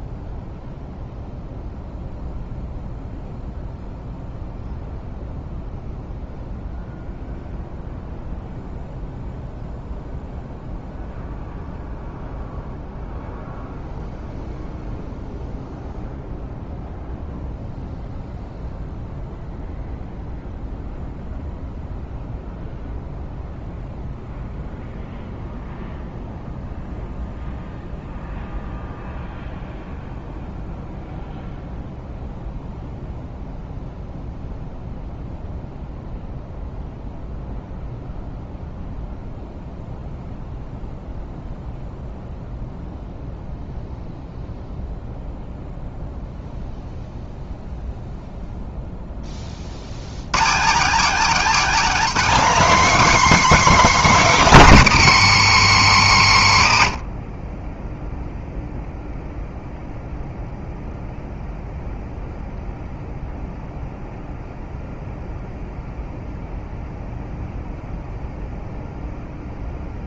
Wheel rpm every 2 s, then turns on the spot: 0, 0, 0, 0, 0, 0, 0, 0, 0, 0, 0, 0, 0, 0, 0, 0, 0, 0, 0, 0, 0, 0, 0, 0, 0, 230, 300, 200, 60, 0, 0, 0, 0, 0, 0.
none